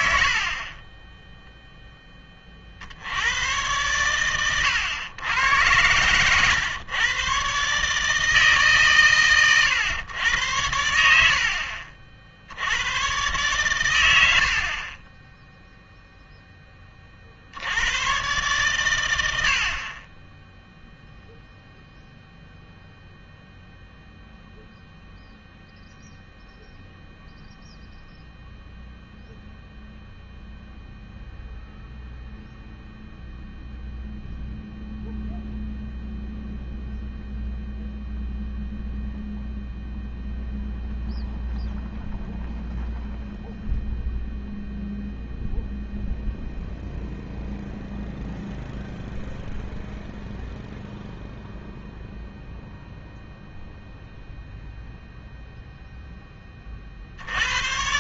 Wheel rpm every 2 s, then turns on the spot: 60, 30, 110, 120, 150, 90, 90, 50, 10, 120, 0, 0, 0, 0, 0, 0, 0, 0, 0, 0, 0, 0, 0, 0, 0, 0, 0, 0, 30.
none